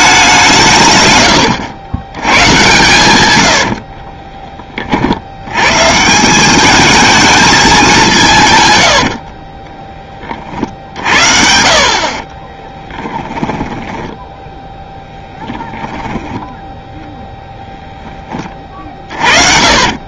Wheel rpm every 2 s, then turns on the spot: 140, 110, 30, 200, 120, 60, 20, 10, 10, 20.
12-16 18-20